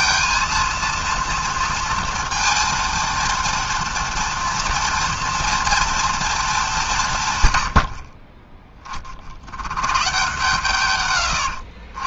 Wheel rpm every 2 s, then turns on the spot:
230, 230, 230, 200, 20, 120.
none